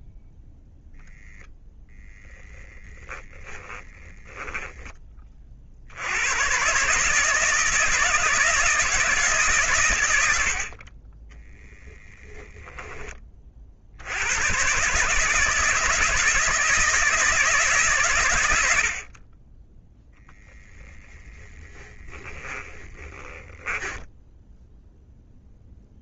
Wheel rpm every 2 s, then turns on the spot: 10, 20, 90, 160, 100, 10, 70, 160, 130, 0, 10, 10, 0.
0-4 20-24